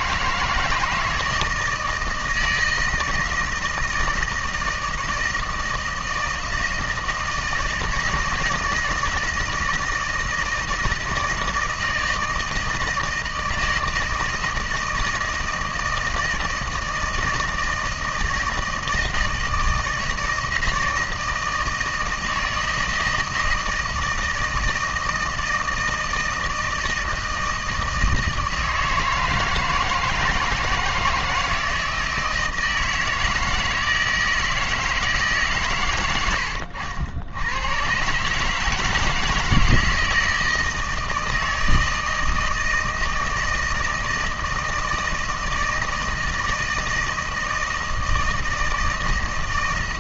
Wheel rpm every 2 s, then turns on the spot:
160, 160, 160, 160, 160, 160, 160, 160, 160, 160, 160, 160, 160, 160, 160, 160, 160, 160, 70, 150, 160, 160, 160, 160, 160.
36-38